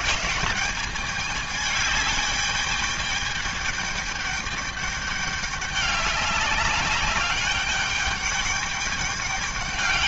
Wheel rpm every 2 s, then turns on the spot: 180, 210, 210, 200, 200.
none